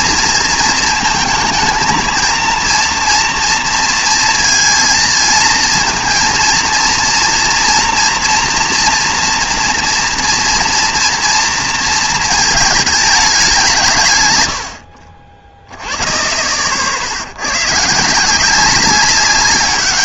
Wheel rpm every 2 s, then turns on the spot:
230, 230, 230, 230, 240, 240, 220, 90, 40, 180.
none